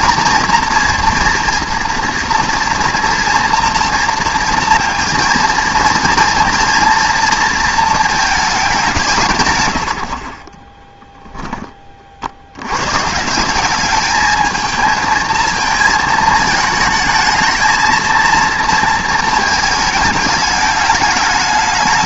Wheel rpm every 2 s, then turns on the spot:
230, 230, 230, 230, 200, 20, 100, 220, 220, 220, 210.
none